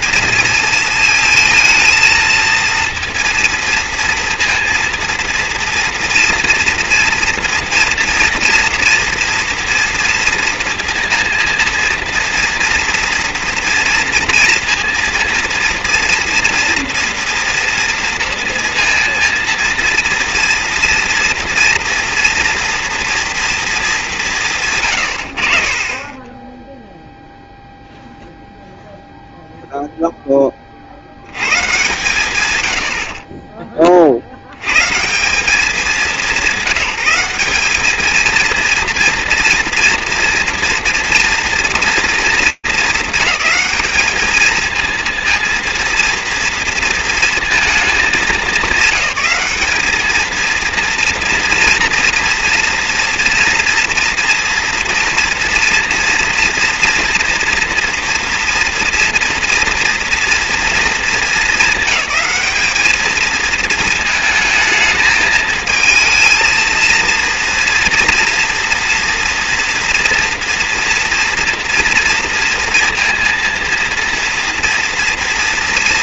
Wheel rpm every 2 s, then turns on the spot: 230, 230, 230, 230, 230, 230, 230, 230, 230, 230, 230, 230, 140, 0, 0, 30, 100, 110, 180, 230, 230, 220, 220, 230, 200, 230, 230, 230, 230, 240, 230, 210, 220, 220, 230, 230, 230, 240.
none